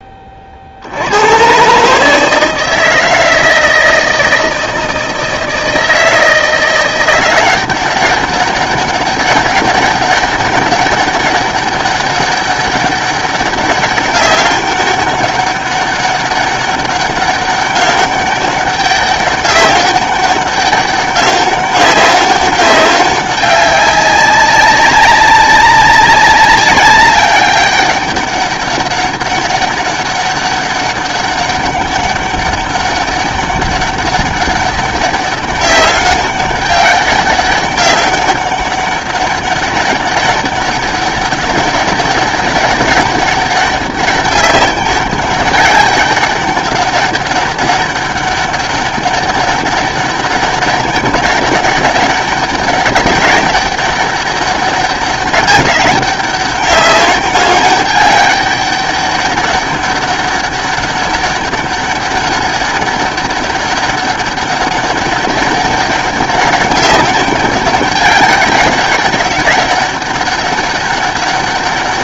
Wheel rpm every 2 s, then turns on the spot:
50, 160, 160, 170, 200, 200, 200, 200, 200, 200, 200, 200, 190, 200, 200, 200, 200, 200, 200, 200, 200, 200, 200, 200, 200, 190, 200, 200, 200, 200, 200, 200, 200, 200, 200, 200.
none